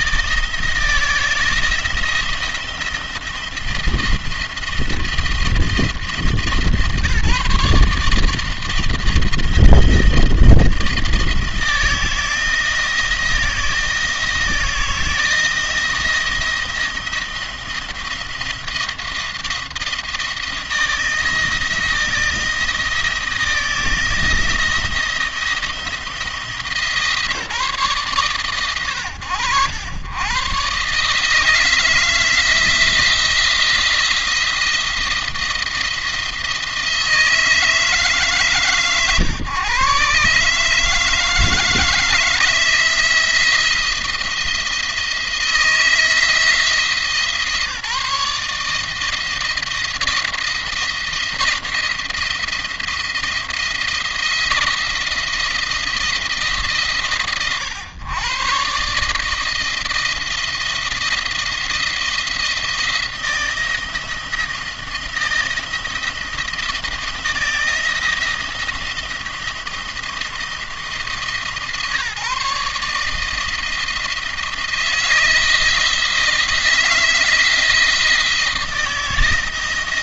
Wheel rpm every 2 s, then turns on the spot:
160, 170, 170, 160, 160, 170, 170, 160, 170, 170, 160, 170, 170, 160, 100, 140, 170, 170, 160, 140, 150, 170, 160, 160, 160, 170, 170, 170, 150, 140, 170, 170, 170, 170, 170, 160, 160, 160, 160, 170.
none